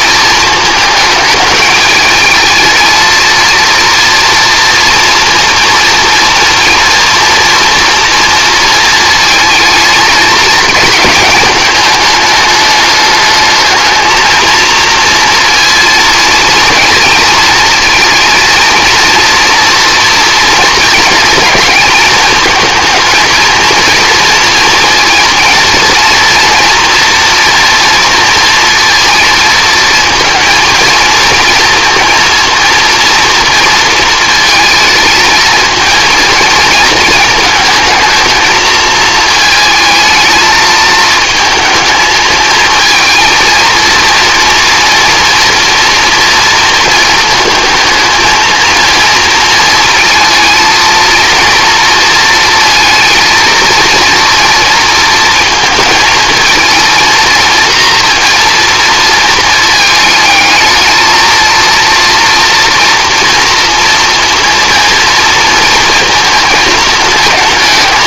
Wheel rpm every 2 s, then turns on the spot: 220, 220, 230, 230, 230, 220, 210, 230, 230, 230, 230, 220, 230, 230, 230, 230, 230, 230, 220, 230, 220, 230, 230, 220, 230, 230, 230, 230, 230, 230, 220, 230, 230, 220.
none